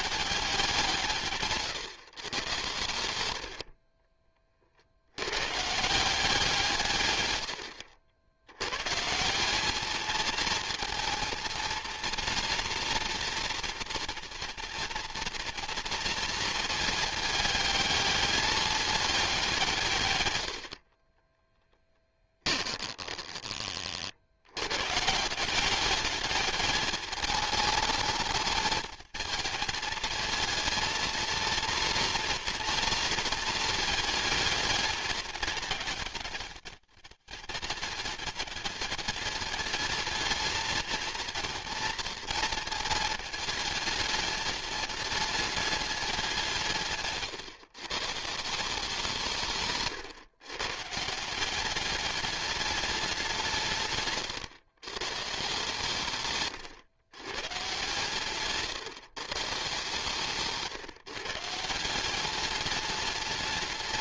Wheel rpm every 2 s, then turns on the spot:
190, 110, 50, 150, 130, 230, 230, 240, 220, 210, 50, 20, 110, 210, 220, 230, 230, 210, 200, 210, 230, 230, 210, 150, 180, 140, 210, 130, 120, 140, 150, 210.
22-24 56-58